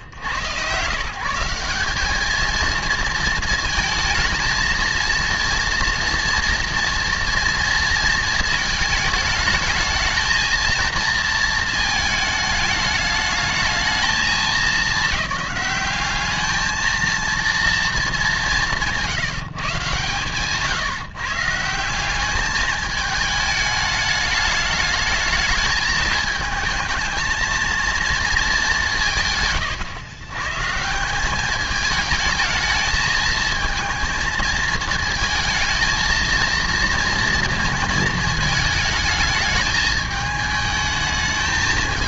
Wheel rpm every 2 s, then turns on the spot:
100, 220, 220, 230, 230, 220, 220, 220, 210, 200, 130, 210, 210, 220, 220, 120, 210, 230, 220, 220, 210.
none